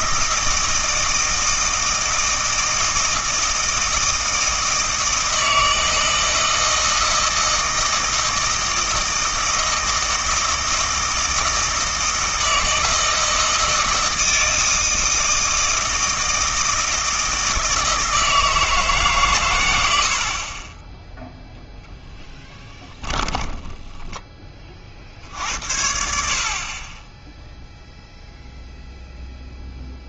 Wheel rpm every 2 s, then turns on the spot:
160, 160, 160, 160, 160, 160, 160, 160, 160, 160, 30, 10, 40, 40, 0.
20-24